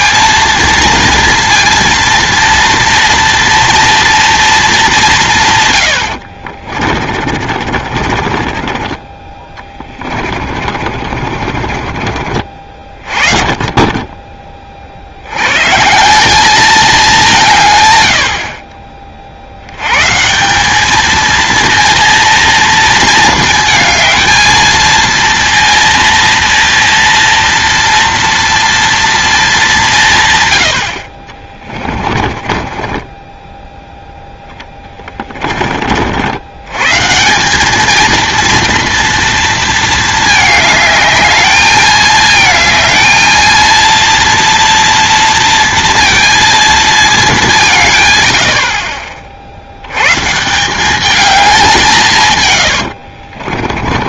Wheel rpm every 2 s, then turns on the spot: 230, 230, 210, 40, 20, 40, 40, 40, 210, 40, 210, 230, 230, 230, 240, 70, 20, 30, 130, 230, 210, 220, 230, 220, 40, 180, 80.
6-12 32-36 52-54